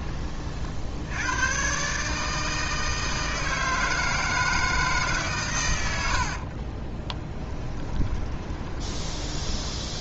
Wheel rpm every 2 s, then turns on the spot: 60, 160, 150, 20, 20.
6-8